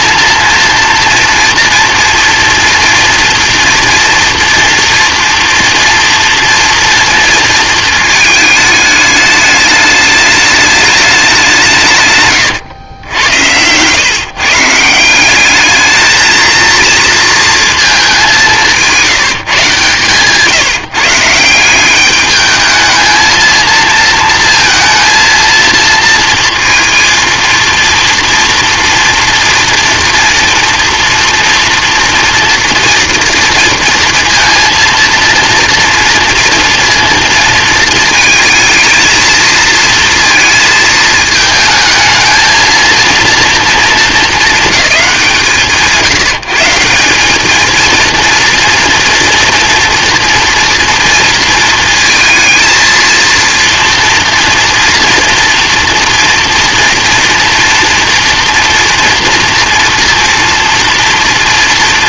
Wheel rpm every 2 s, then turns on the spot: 230, 240, 230, 230, 220, 210, 110, 150, 220, 180, 150, 210, 230, 230, 230, 230, 230, 230, 230, 230, 230, 230, 220, 160, 230, 230, 230, 230, 240, 230, 230.
12-14